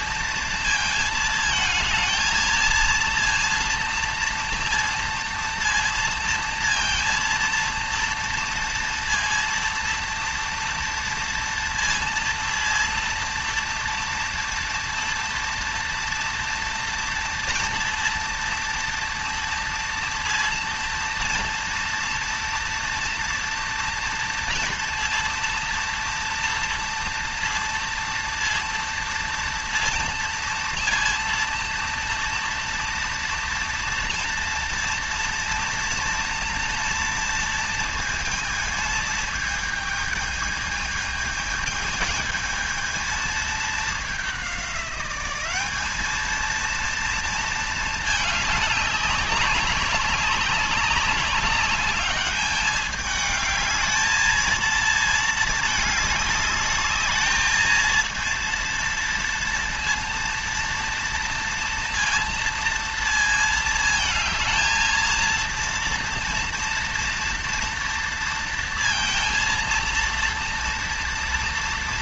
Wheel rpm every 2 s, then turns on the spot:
220, 230, 230, 230, 230, 230, 230, 230, 230, 230, 230, 230, 230, 230, 230, 230, 230, 230, 230, 220, 220, 220, 200, 230, 210, 190, 210, 230, 210, 230, 230, 230, 230, 230, 230, 230.
none